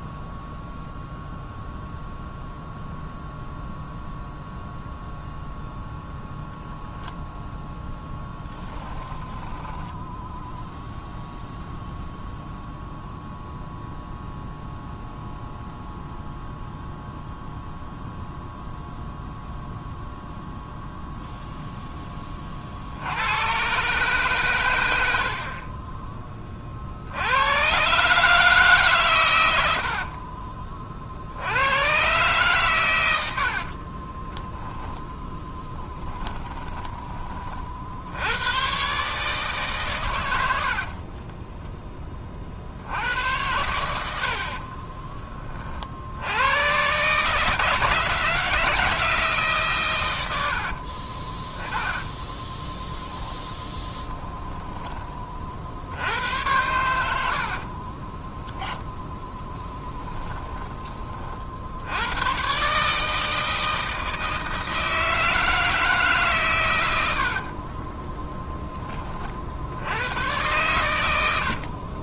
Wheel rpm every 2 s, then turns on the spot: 0, 0, 0, 0, 10, 0, 0, 0, 0, 0, 0, 60, 100, 50, 140, 40, 120, 10, 10, 130, 60, 70, 30, 120, 170, 50, 10, 10, 100, 20, 20, 150, 160, 110, 20, 110.
8-10 36-38 40-42 44-46 50-54